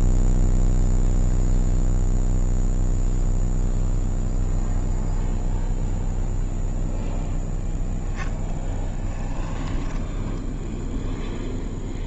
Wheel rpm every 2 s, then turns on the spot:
0, 0, 0, 0, 10, 0.
8-10